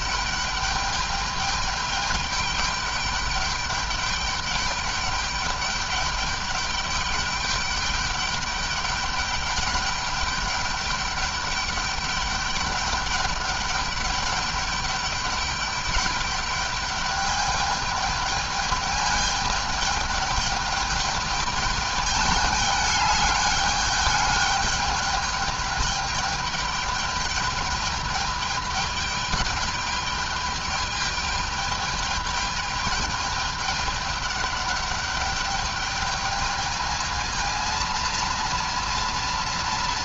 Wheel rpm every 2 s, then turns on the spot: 210, 210, 210, 200, 200, 210, 200, 200, 210, 210, 210, 210, 210, 210, 210, 210, 210, 210, 220, 230.
none